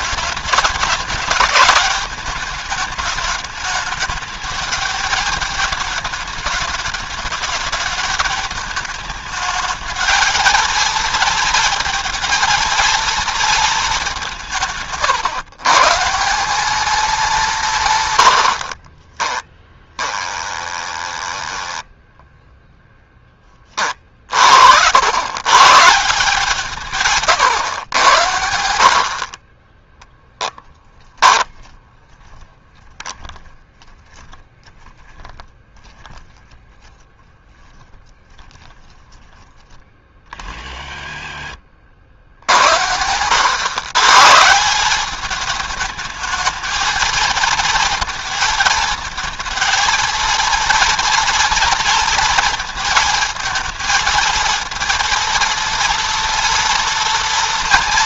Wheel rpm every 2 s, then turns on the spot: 210, 210, 220, 210, 220, 230, 230, 150, 210, 60, 20, 10, 80, 160, 60, 10, 10, 10, 10, 10, 50, 80, 190, 220, 220, 230, 230, 230, 230.
18-22